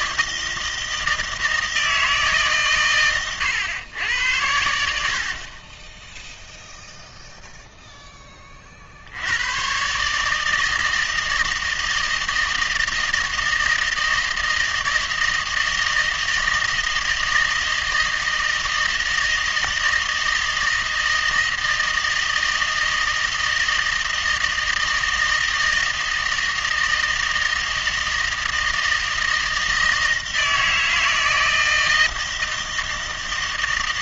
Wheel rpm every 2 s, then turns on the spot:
160, 140, 80, 0, 50, 160, 160, 160, 160, 160, 160, 160, 160, 160, 160, 160, 160.
none